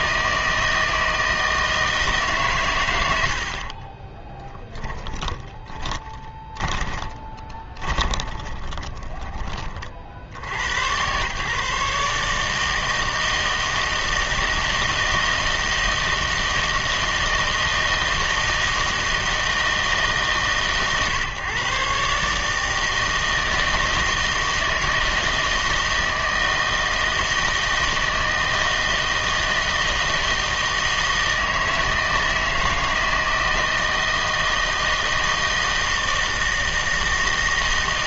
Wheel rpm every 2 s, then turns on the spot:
160, 120, 30, 20, 20, 90, 160, 160, 160, 160, 140, 160, 160, 160, 160, 160, 160, 160, 160.
4-10